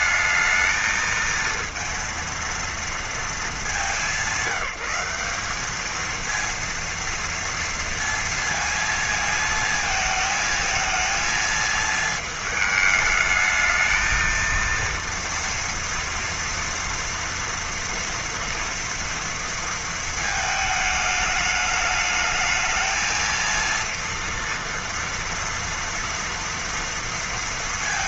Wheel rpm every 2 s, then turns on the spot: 230, 220, 190, 230, 220, 220, 220, 230, 240, 230, 210, 230, 230, 230.
none